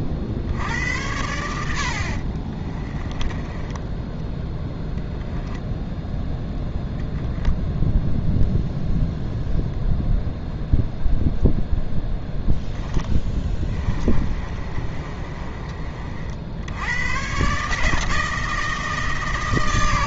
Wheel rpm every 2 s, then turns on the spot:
80, 20, 0, 0, 0, 0, 10, 30, 100, 160.
2-4 12-16